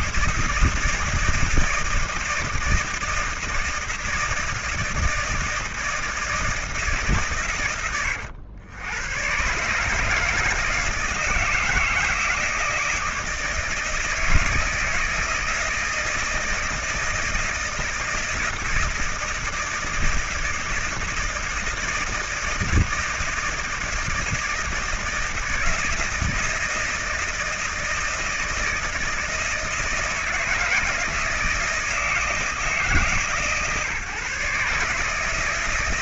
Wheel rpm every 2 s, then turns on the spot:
160, 160, 160, 160, 90, 150, 160, 160, 160, 160, 160, 160, 160, 160, 160, 160, 160, 150.
none